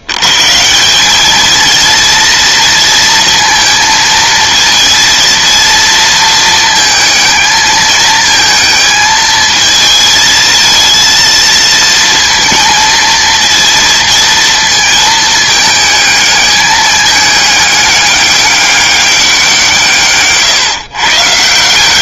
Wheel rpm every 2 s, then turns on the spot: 90, 230, 230, 230, 220, 220, 230, 230, 210, 200, 140.
none